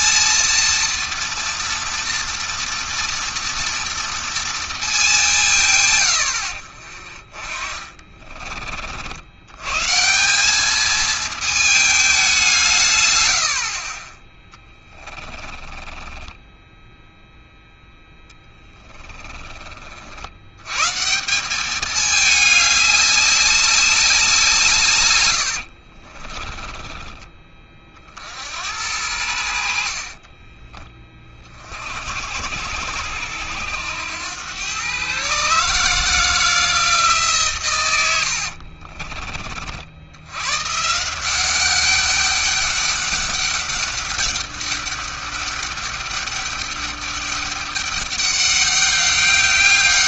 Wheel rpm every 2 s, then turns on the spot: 230, 230, 220, 60, 50, 200, 160, 20, 10, 10, 120, 200, 150, 20, 70, 30, 70, 120, 160, 50, 140, 200, 200, 200, 200.
14-16 18-20 38-40